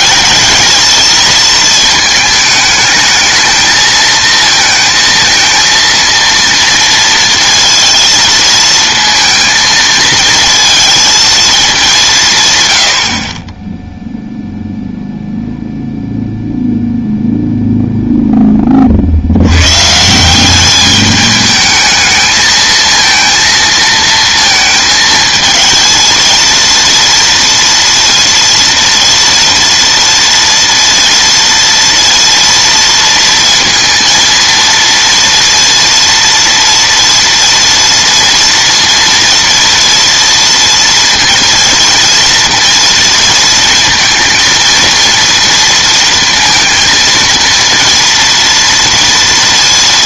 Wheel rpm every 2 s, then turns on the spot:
220, 210, 220, 230, 230, 230, 90, 0, 0, 40, 200, 220, 220, 230, 230, 230, 230, 230, 230, 230, 230, 230, 230, 220, 230.
none